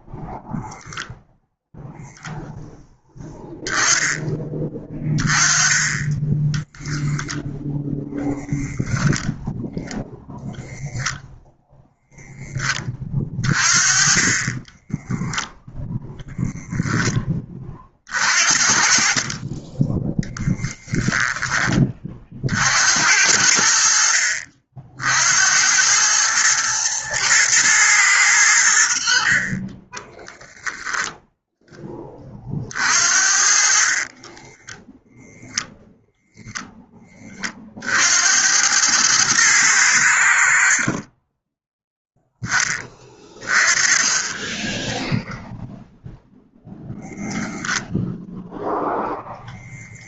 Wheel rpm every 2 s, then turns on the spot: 0, 0, 20, 0, 0, 0, 20, 10, 10, 40, 10, 60, 60, 110, 70, 0, 50, 10, 10, 100, 30, 20, 10, 0, 0.
14-16 34-36